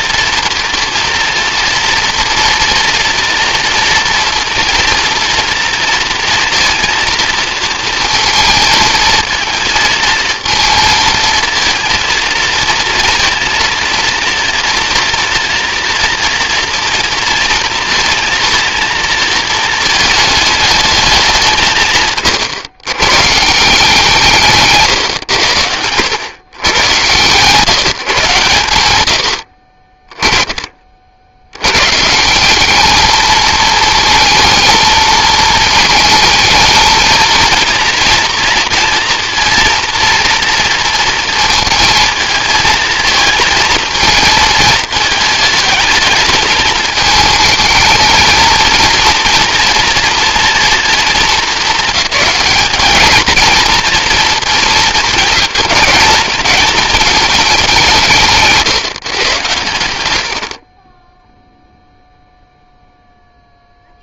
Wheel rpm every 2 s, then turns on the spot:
230, 230, 230, 230, 230, 230, 230, 240, 240, 240, 220, 120, 150, 120, 130, 20, 200, 220, 220, 230, 230, 220, 220, 220, 230, 240, 210, 220, 220, 150, 60, 0.
none